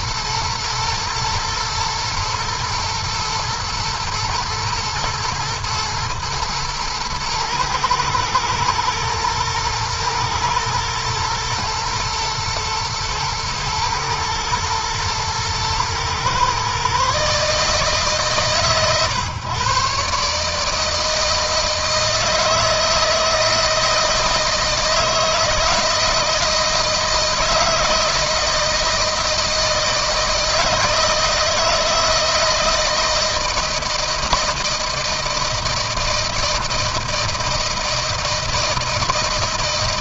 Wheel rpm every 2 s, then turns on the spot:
120, 120, 120, 110, 110, 120, 110, 110, 130, 140, 150, 160, 160, 160, 160, 160, 170, 160, 160, 160.
none